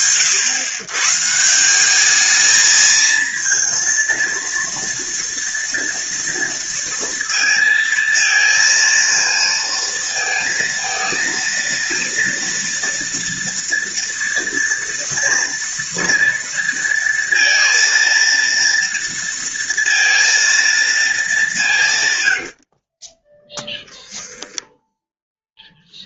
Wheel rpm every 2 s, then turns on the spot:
150, 220, 230, 230, 230, 230, 230, 230, 230, 230, 210, 20, 0.
none